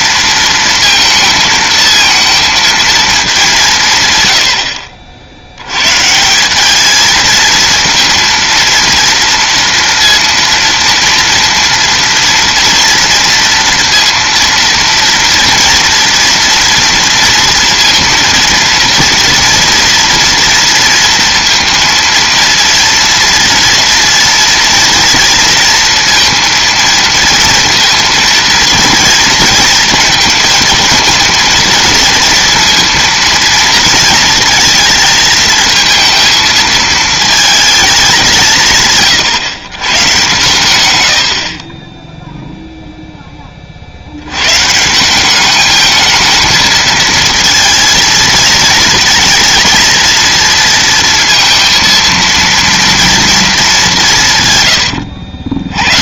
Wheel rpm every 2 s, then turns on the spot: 230, 230, 70, 200, 230, 230, 230, 230, 230, 230, 230, 230, 230, 230, 230, 220, 230, 220, 220, 160, 130, 0, 150, 230, 230, 230, 230, 120.
54-56